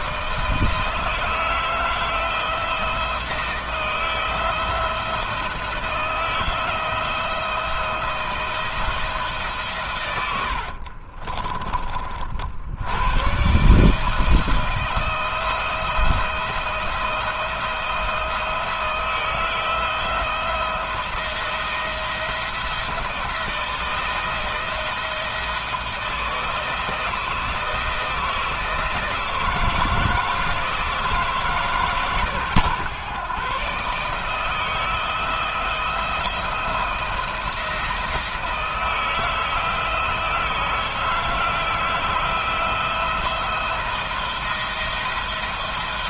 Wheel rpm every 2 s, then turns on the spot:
160, 160, 170, 170, 160, 50, 90, 160, 170, 160, 170, 170, 160, 170, 160, 160, 130, 160, 170, 160, 160, 160, 170.
10-12